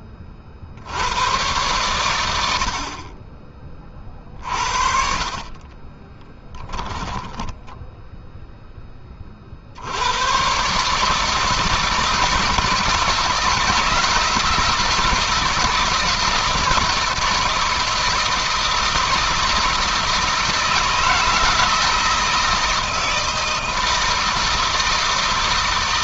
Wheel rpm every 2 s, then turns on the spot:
70, 50, 50, 30, 20, 140, 150, 160, 160, 160, 160, 160, 160.
4-8